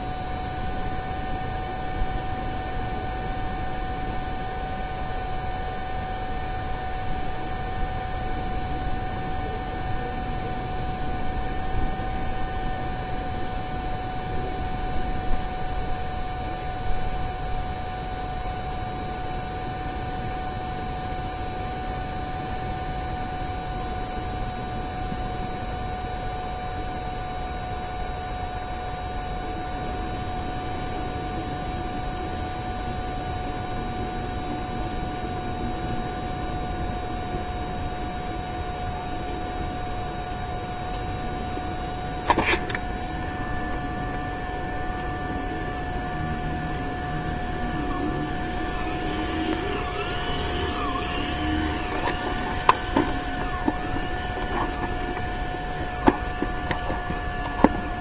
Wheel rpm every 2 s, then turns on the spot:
0, 0, 0, 0, 0, 0, 0, 0, 0, 0, 0, 0, 0, 0, 0, 0, 0, 0, 0, 0, 0, 0, 0, 0, 0, 0, 0, 0, 0.
none